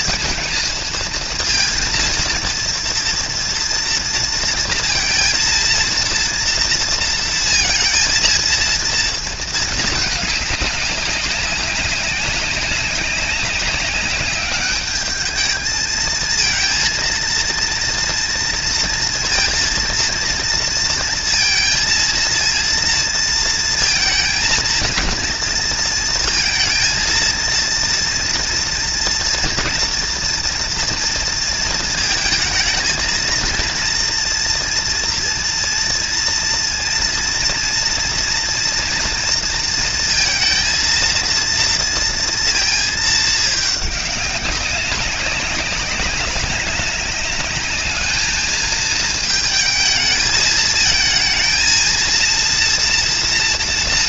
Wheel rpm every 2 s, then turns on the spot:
230, 230, 230, 230, 230, 200, 200, 210, 230, 230, 230, 230, 230, 230, 230, 230, 220, 240, 230, 230, 230, 220, 200, 190, 220, 220, 230.
none